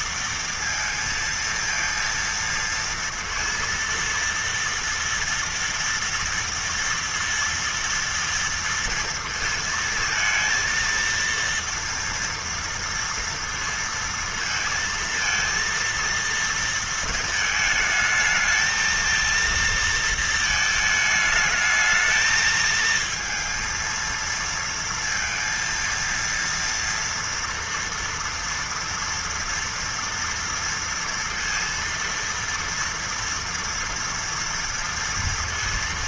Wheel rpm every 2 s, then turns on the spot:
230, 230, 230, 230, 230, 230, 230, 230, 230, 220, 220, 220, 230, 230, 230, 230, 230, 230.
none